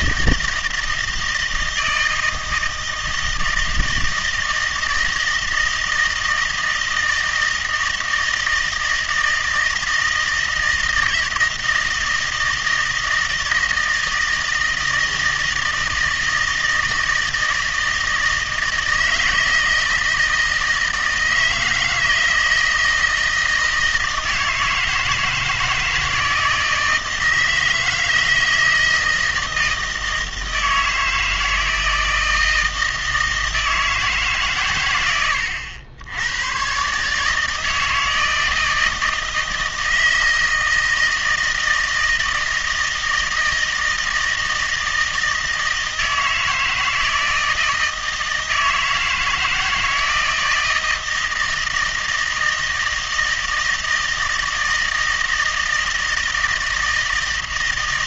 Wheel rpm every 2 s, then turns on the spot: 160, 160, 160, 160, 160, 160, 160, 160, 160, 160, 160, 160, 160, 170, 160, 160, 160, 130, 120, 160, 160, 160, 160, 160, 160, 160, 160, 160, 160.
none